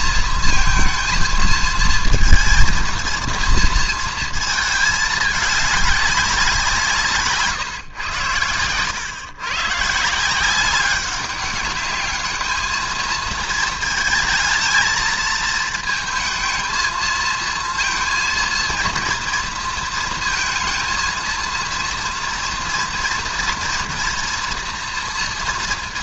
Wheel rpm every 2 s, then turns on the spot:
230, 230, 220, 180, 100, 180, 220, 220, 220, 230, 230, 230, 230.
none